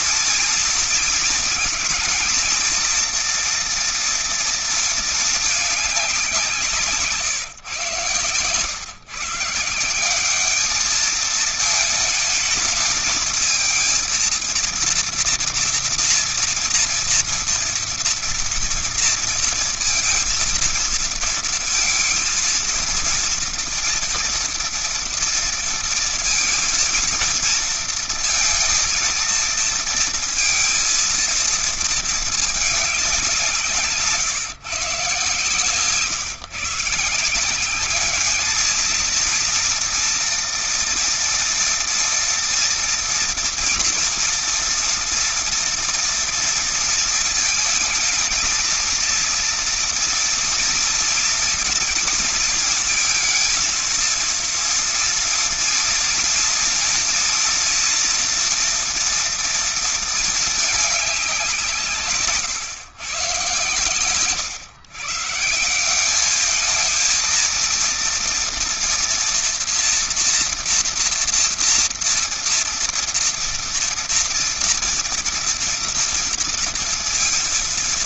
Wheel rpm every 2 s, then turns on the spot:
230, 230, 230, 170, 120, 200, 220, 230, 230, 230, 230, 230, 230, 230, 230, 230, 220, 140, 140, 210, 230, 230, 230, 230, 220, 240, 230, 230, 230, 240, 220, 140, 130, 210, 230, 240, 230, 230, 230.
none